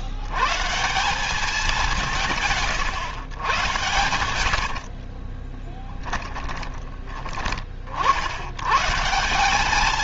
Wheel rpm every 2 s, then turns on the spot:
180, 130, 50, 20, 140.
4-6